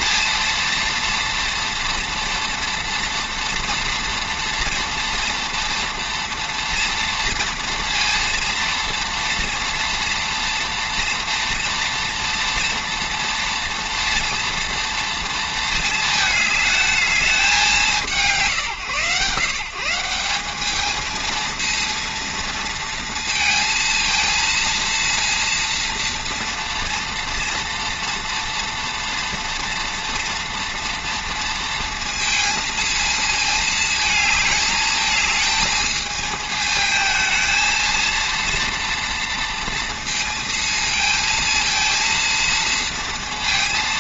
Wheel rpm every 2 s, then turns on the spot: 230, 240, 230, 240, 230, 230, 230, 230, 210, 120, 200, 230, 230, 230, 240, 240, 230, 220, 220, 230, 220, 220.
none